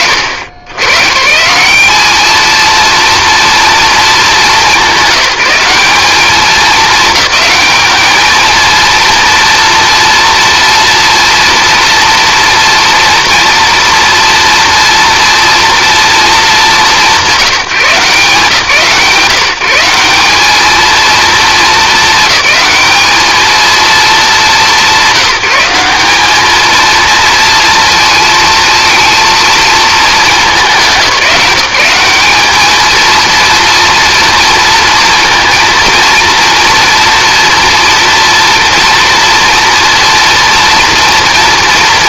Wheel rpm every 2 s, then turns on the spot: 120, 230, 200, 210, 230, 230, 230, 230, 180, 150, 230, 210, 190, 230, 230, 190, 220, 230, 230, 230, 240.
none